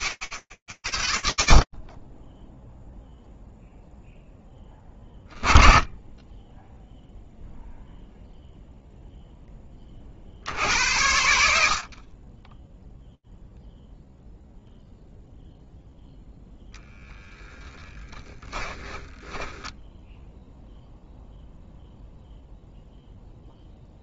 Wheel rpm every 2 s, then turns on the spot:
70, 0, 20, 0, 10, 110, 0, 0, 10, 0, 0, 10.
16-18